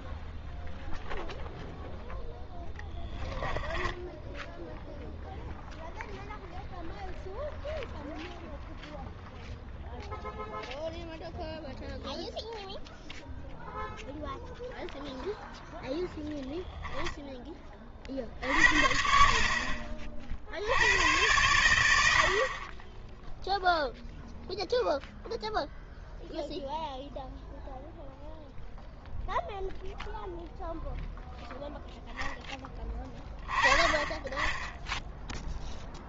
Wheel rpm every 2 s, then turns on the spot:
0, 0, 0, 0, 0, 0, 0, 0, 0, 60, 60, 30, 0, 0, 0, 0, 10, 10.
none